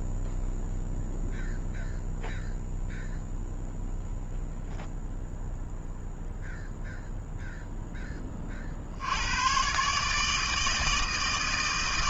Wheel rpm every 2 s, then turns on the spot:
0, 0, 0, 0, 40, 160.
none